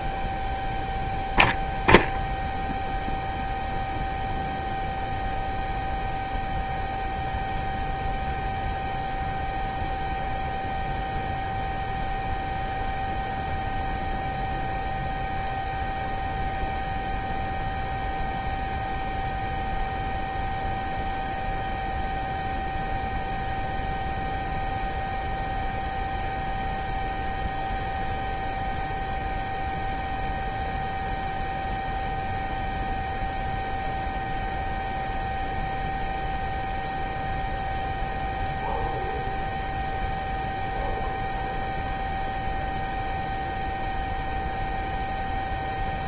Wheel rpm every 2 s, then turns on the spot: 0, 0, 0, 0, 0, 0, 0, 0, 0, 0, 0, 0, 0, 0, 0, 0, 0, 0, 0, 0, 0, 0, 0.
none